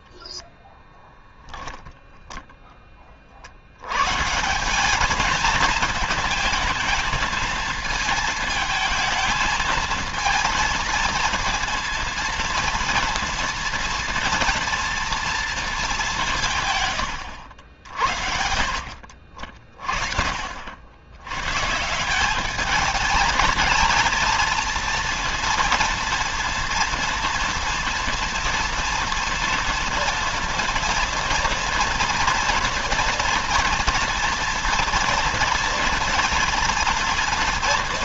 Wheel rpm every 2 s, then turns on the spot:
0, 10, 170, 220, 220, 230, 230, 230, 140, 60, 70, 200, 230, 230, 230, 230, 230, 230, 230.
none